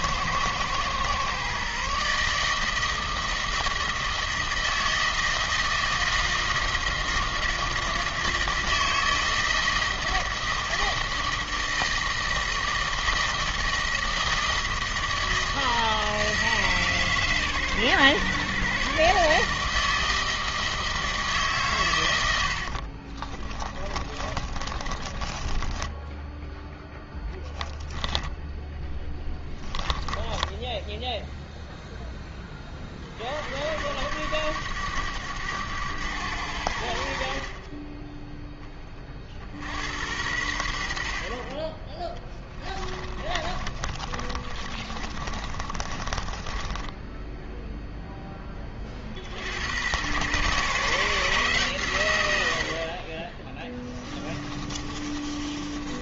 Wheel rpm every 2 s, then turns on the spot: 120, 160, 160, 160, 160, 160, 160, 160, 140, 140, 160, 50, 20, 0, 10, 10, 40, 100, 70, 30, 60, 20, 40, 20, 50, 140, 50, 30.
22-26 28-30 42-48 54-56